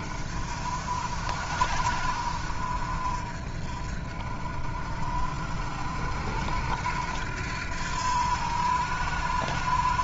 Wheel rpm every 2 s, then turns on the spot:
50, 50, 50, 80, 80.
none